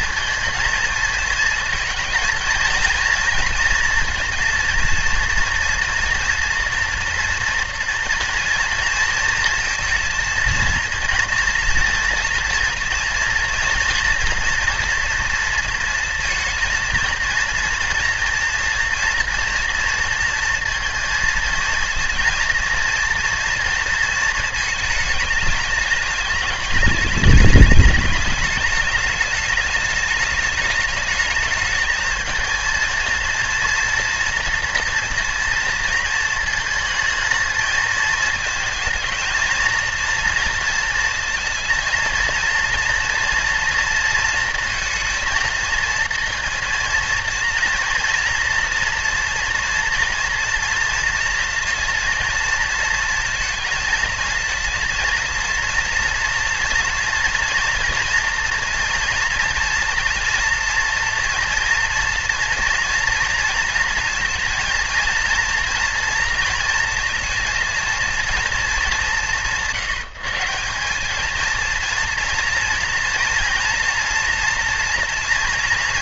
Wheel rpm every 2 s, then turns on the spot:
230, 230, 230, 240, 230, 230, 230, 230, 230, 240, 230, 230, 220, 210, 210, 210, 230, 240, 220, 220, 230, 230, 230, 230, 230, 230, 230, 230, 230, 240, 230, 230, 230, 230, 180, 180, 230, 230.
none